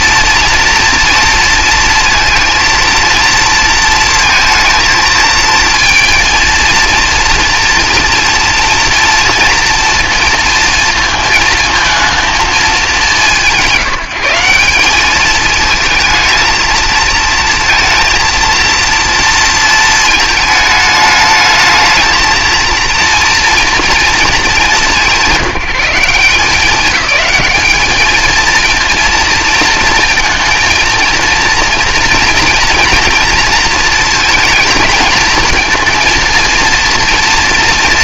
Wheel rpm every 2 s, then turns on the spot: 230, 230, 230, 230, 240, 230, 210, 190, 230, 230, 220, 230, 160, 200, 230, 230, 230, 220, 230.
none